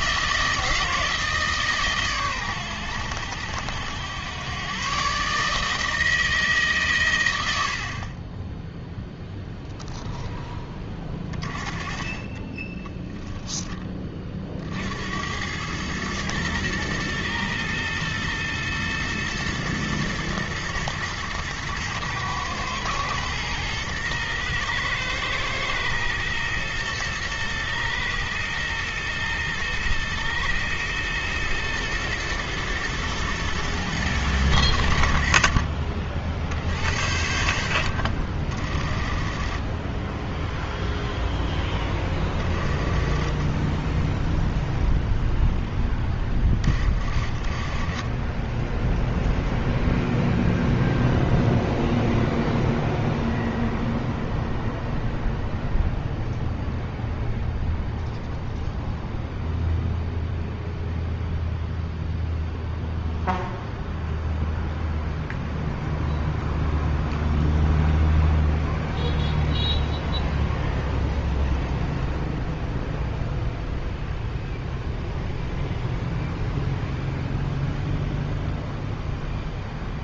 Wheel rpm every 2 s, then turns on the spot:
160, 120, 120, 140, 10, 20, 20, 50, 110, 110, 110, 110, 110, 120, 110, 110, 120, 90, 70, 40, 0, 30, 0, 30, 10, 0, 0, 0, 0, 0, 0, 0, 0, 0, 0, 0, 0, 0, 0, 0.
12-14